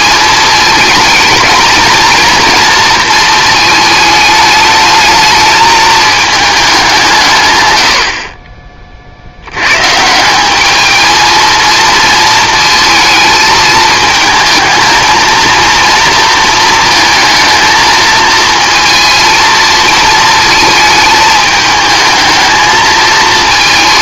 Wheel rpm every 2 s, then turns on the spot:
220, 230, 210, 200, 30, 210, 220, 220, 220, 220, 220, 220.
none